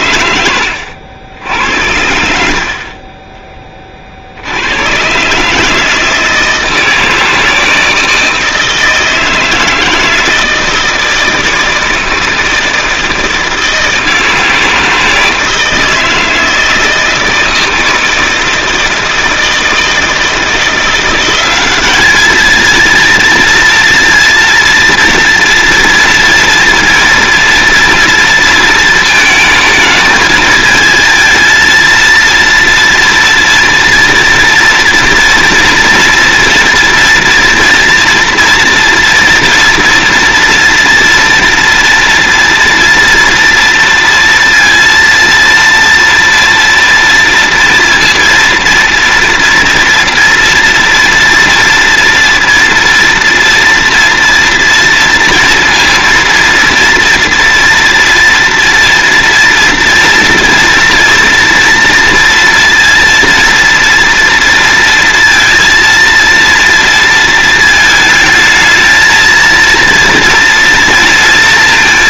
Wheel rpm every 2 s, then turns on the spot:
90, 60, 90, 160, 160, 160, 160, 160, 160, 160, 170, 220, 230, 230, 220, 220, 230, 230, 230, 240, 230, 230, 230, 230, 230, 230, 230, 230, 230, 230, 230, 230, 230, 230, 220, 230.
0-2